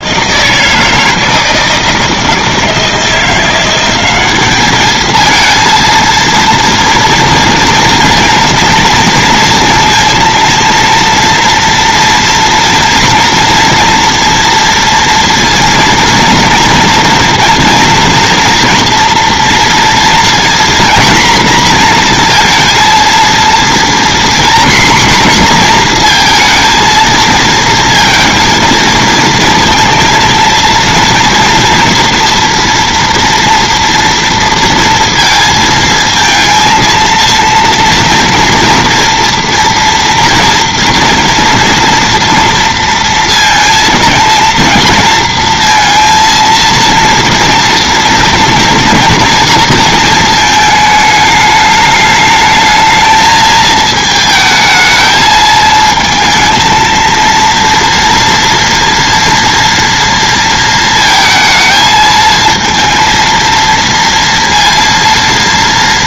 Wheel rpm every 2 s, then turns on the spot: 160, 160, 210, 230, 230, 230, 240, 230, 230, 230, 230, 230, 240, 230, 230, 230, 240, 230, 230, 230, 230, 230, 230, 230, 230, 220, 220, 220, 230, 230, 220, 230, 230.
none